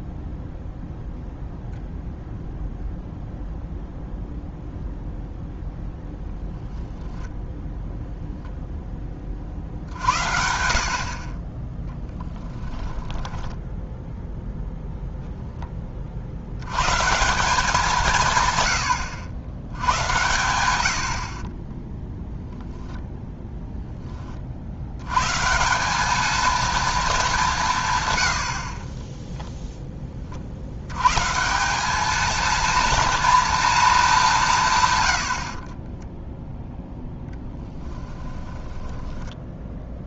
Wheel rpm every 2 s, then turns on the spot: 0, 0, 0, 0, 0, 60, 10, 0, 110, 100, 100, 0, 60, 230, 40, 80, 230, 150, 0, 10.
12-14 38-40